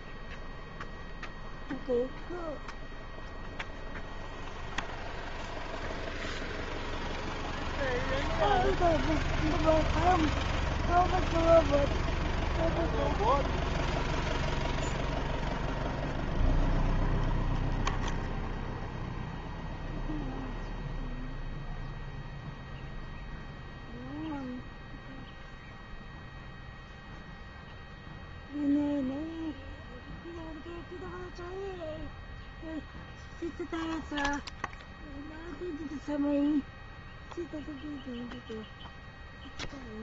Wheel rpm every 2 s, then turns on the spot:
0, 0, 0, 0, 0, 0, 0, 0, 0, 0, 0, 0, 0, 0, 0, 0, 0, 0, 0, 0.
none